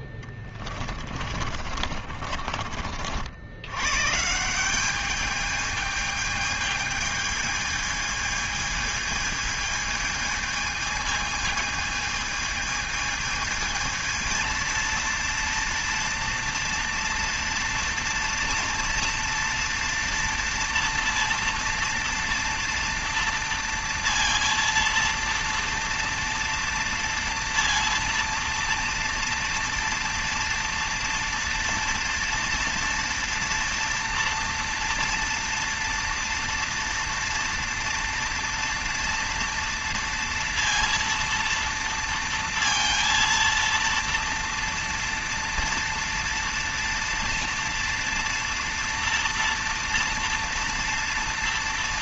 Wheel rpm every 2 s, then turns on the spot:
20, 40, 170, 220, 220, 220, 220, 230, 230, 230, 240, 230, 230, 230, 230, 240, 230, 230, 230, 230, 230, 230, 230, 230, 230, 230.
0-2